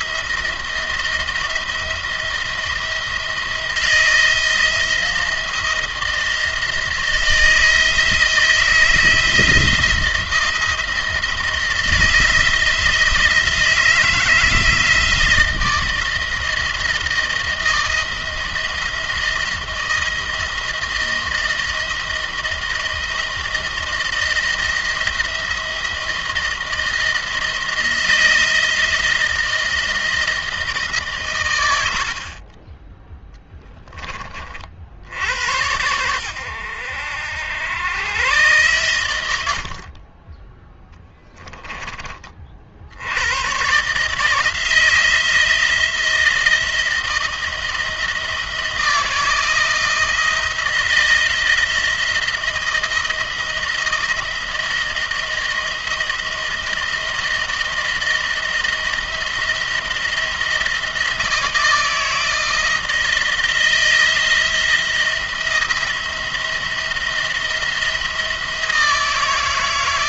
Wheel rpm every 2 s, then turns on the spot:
170, 170, 170, 170, 160, 170, 170, 160, 160, 170, 160, 160, 160, 170, 170, 150, 20, 40, 90, 110, 10, 60, 160, 160, 160, 170, 160, 170, 170, 170, 170, 160, 170, 170, 160.
none